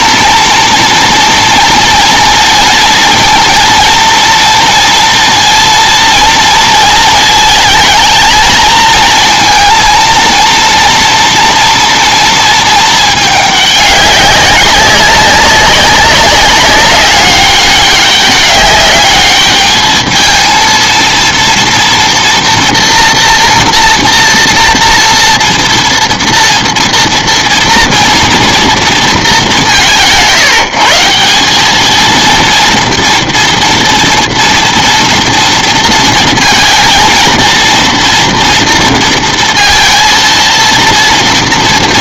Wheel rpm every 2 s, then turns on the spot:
240, 230, 230, 220, 220, 230, 220, 200, 200, 200, 220, 230, 230, 230, 230, 150, 240, 230, 230, 230, 230.
none